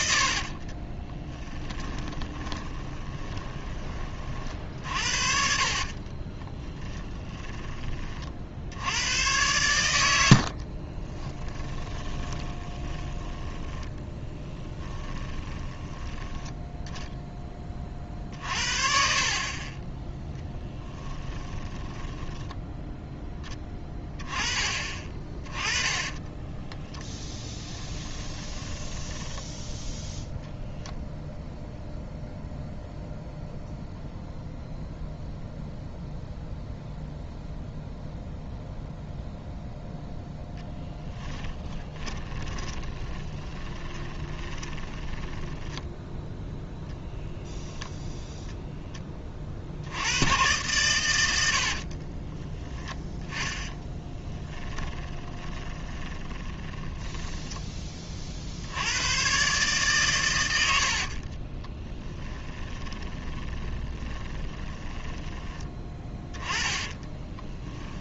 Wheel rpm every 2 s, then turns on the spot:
30, 20, 50, 20, 80, 40, 30, 10, 0, 40, 10, 0, 30, 10, 10, 0, 0, 0, 0, 0, 10, 20, 20, 0, 10, 110, 10, 10, 20, 80, 90, 20, 20, 20.
0-4 6-8 10-16 20-22 26-30 40-46 54-58 60-68